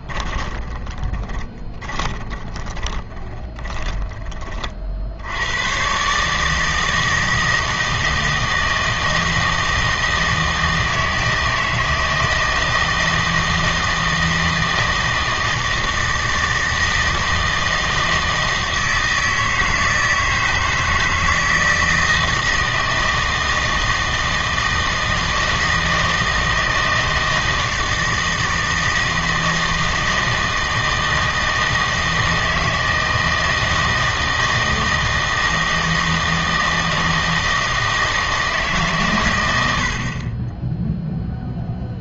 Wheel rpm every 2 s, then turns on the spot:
20, 20, 50, 160, 160, 160, 160, 160, 160, 160, 160, 160, 160, 160, 160, 160, 160, 160, 160, 150, 10.
0-4